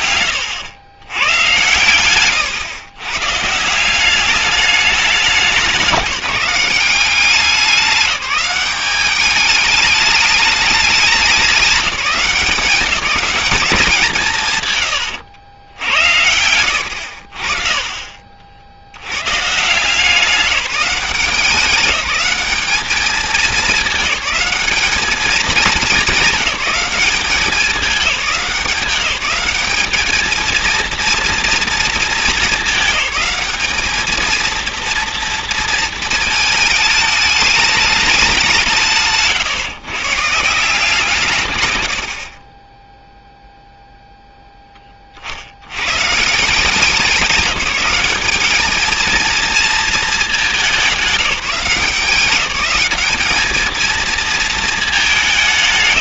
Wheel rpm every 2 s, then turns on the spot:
120, 120, 210, 190, 200, 210, 180, 140, 80, 70, 180, 210, 200, 200, 190, 230, 210, 230, 220, 160, 170, 20, 20, 190, 220, 190, 190, 220.
16-18